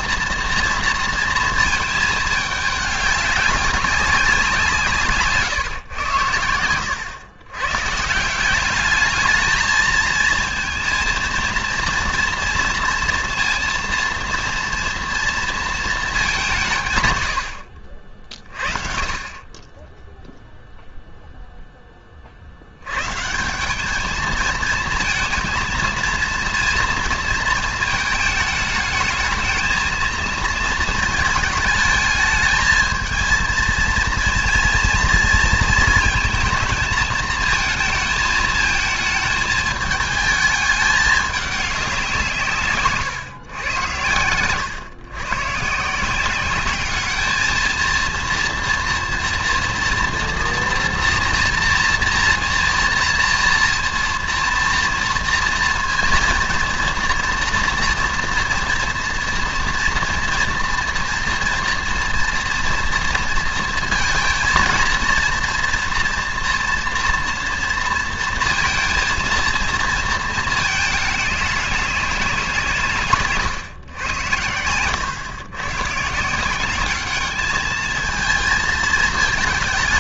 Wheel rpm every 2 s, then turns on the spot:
230, 210, 180, 90, 200, 220, 230, 230, 160, 30, 0, 80, 230, 230, 220, 220, 220, 230, 230, 220, 210, 150, 120, 200, 230, 230, 230, 230, 230, 230, 240, 230, 230, 230, 230, 220, 180, 100, 190, 220.
none